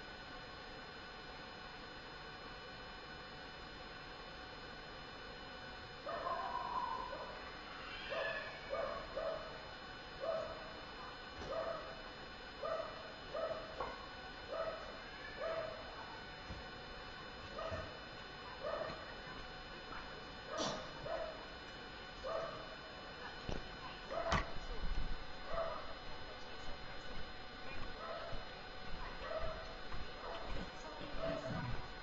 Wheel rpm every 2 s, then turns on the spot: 0, 0, 0, 0, 0, 0, 0, 0, 0, 0, 0, 0, 0, 0, 0, 0.
none